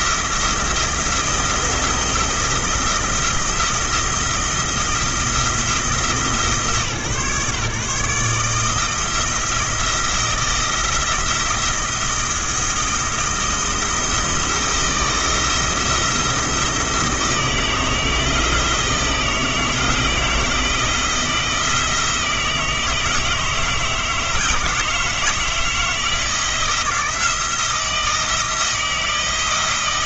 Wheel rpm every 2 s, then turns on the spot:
170, 170, 170, 140, 160, 170, 160, 160, 160, 160, 170, 160, 160, 170, 160.
none